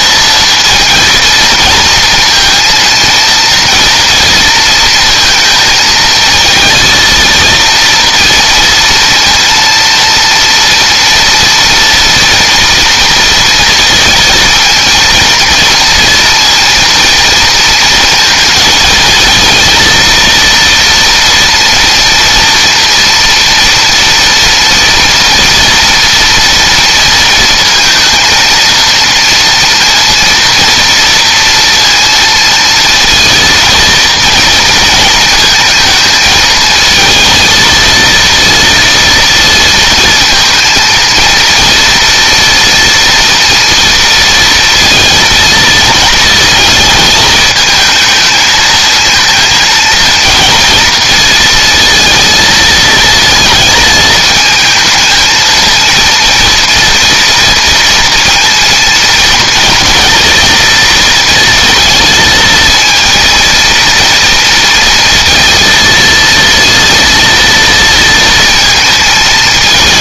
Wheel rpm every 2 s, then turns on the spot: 230, 230, 230, 230, 230, 230, 230, 230, 230, 220, 230, 230, 230, 230, 230, 240, 230, 230, 230, 230, 230, 240, 230, 230, 230, 230, 230, 220, 230, 230, 230, 230, 230, 230, 230.
none